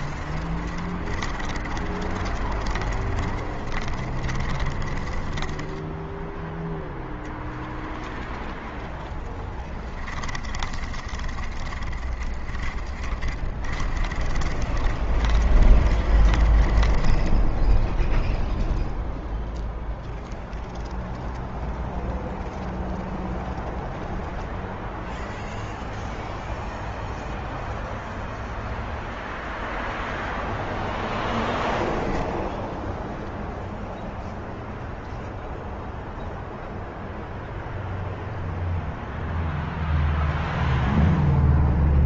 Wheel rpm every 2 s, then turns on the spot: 30, 30, 20, 0, 10, 30, 30, 30, 20, 0, 0, 0, 0, 0, 0, 0, 0, 0, 0, 0, 0.
0-6 8-18